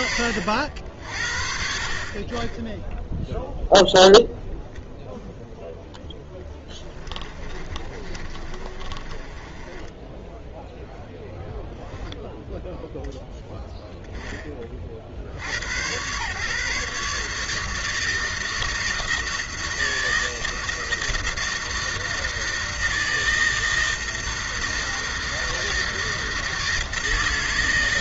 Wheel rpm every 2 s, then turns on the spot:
60, 0, 0, 20, 30, 0, 0, 60, 150, 160, 160, 160, 160, 160.
6-10